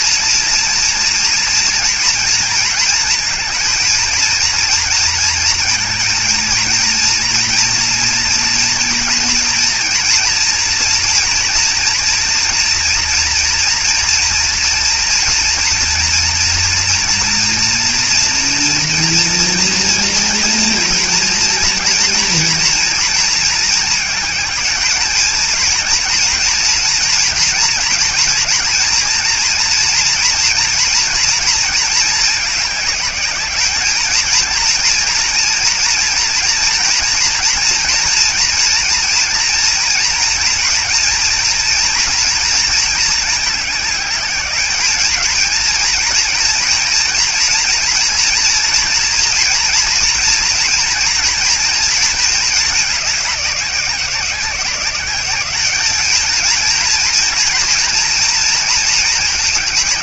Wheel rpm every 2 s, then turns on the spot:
230, 230, 230, 230, 230, 240, 240, 240, 230, 230, 230, 230, 220, 230, 230, 230, 210, 230, 230, 230, 230, 230, 210, 230, 230, 230, 210, 190, 220, 220.
none